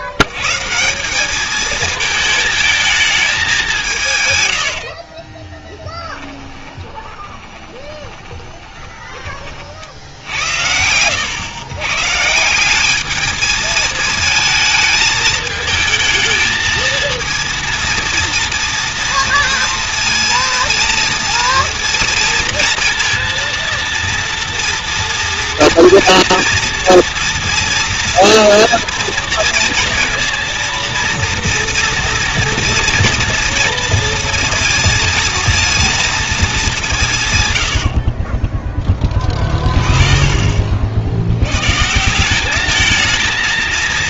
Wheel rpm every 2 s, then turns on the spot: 120, 220, 60, 30, 20, 90, 200, 220, 220, 230, 230, 230, 230, 230, 230, 230, 230, 230, 180, 10, 70, 220.
4-10